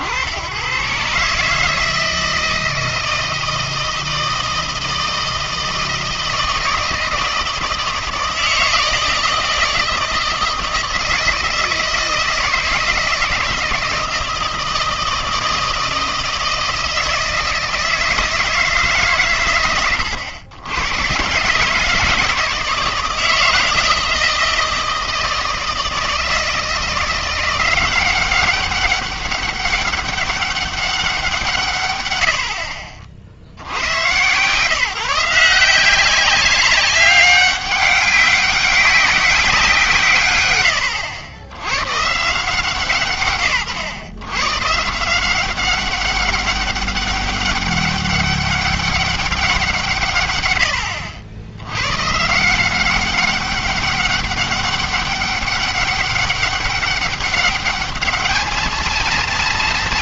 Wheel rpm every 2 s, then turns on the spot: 100, 160, 160, 160, 160, 160, 160, 160, 160, 160, 90, 150, 160, 160, 190, 200, 50, 150, 190, 190, 100, 160, 140, 200, 200, 100, 170, 200, 200, 220.
none